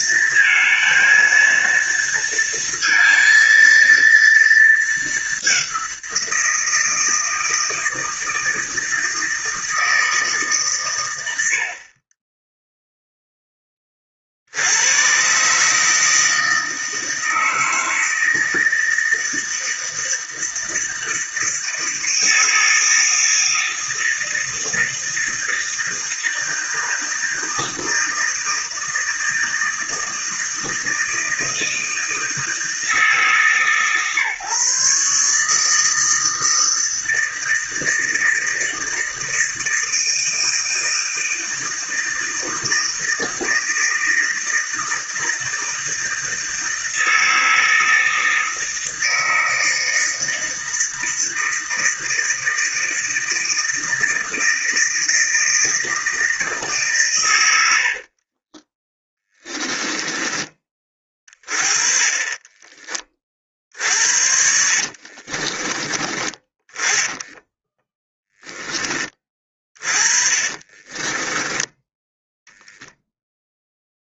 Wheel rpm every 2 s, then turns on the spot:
230, 230, 220, 160, 160, 130, 0, 80, 160, 160, 160, 160, 160, 160, 160, 160, 160, 150, 160, 160, 160, 160, 160, 160, 160, 160, 160, 160, 150, 20, 20, 20, 50, 10, 10, 30, 0.
58-60 64-66 70-72